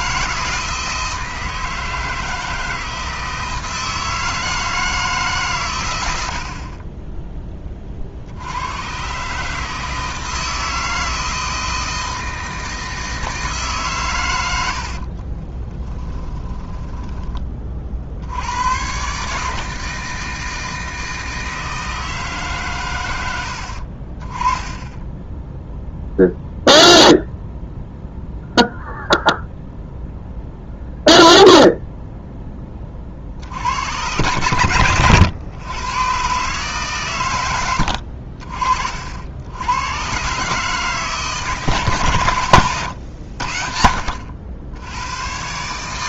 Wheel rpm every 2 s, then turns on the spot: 160, 160, 160, 30, 100, 160, 160, 80, 10, 110, 160, 120, 20, 0, 0, 0, 30, 110, 140, 60, 150, 110, 90.
14-18 24-26